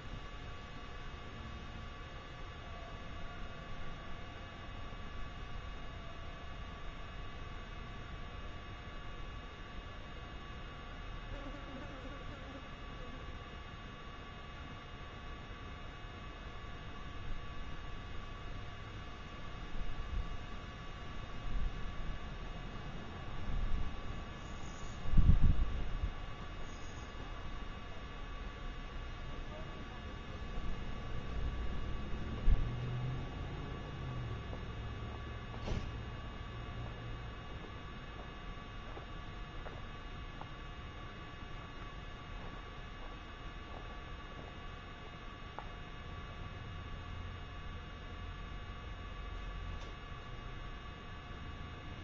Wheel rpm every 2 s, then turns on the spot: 0, 0, 0, 0, 0, 0, 0, 0, 0, 0, 0, 0, 0, 0, 0, 0, 0, 0, 0, 0, 0, 0, 0, 0, 0, 0.
none